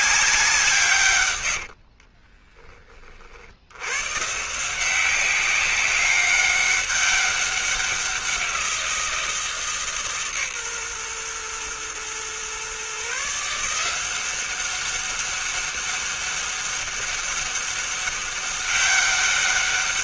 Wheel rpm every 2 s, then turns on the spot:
180, 20, 150, 200, 180, 140, 130, 190, 200, 200.
2-4